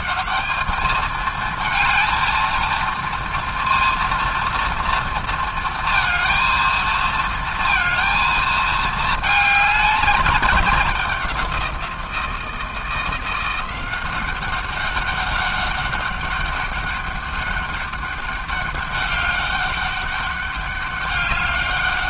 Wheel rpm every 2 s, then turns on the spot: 190, 230, 230, 230, 220, 200, 170, 190, 200, 200, 200.
none